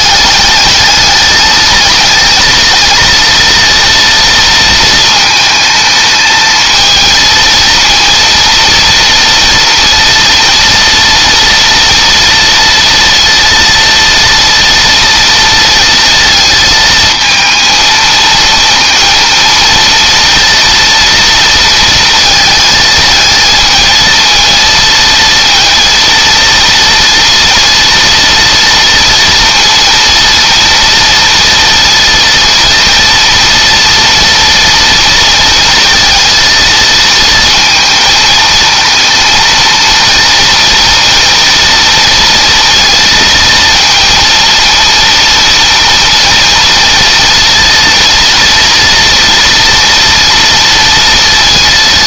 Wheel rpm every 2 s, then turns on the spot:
210, 230, 220, 220, 230, 230, 230, 230, 220, 230, 230, 220, 230, 230, 230, 230, 230, 230, 230, 230, 230, 230, 230, 230, 230, 230.
none